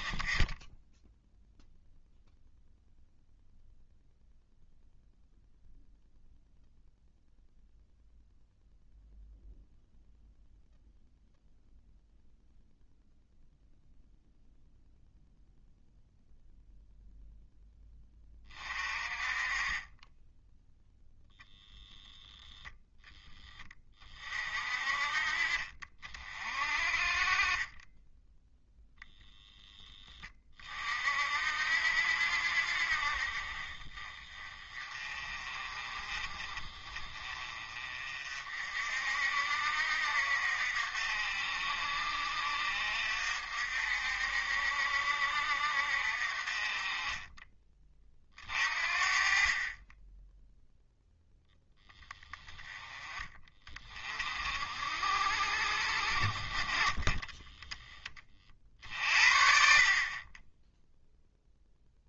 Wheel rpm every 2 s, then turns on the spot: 0, 0, 0, 0, 0, 0, 0, 0, 0, 30, 0, 0, 40, 40, 0, 40, 50, 30, 30, 50, 60, 60, 60, 30, 40, 0, 30, 60, 40, 50, 0.
none